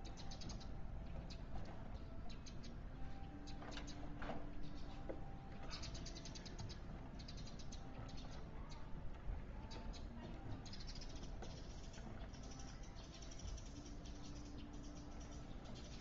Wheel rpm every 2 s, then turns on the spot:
0, 0, 0, 0, 0, 0, 0, 0.
none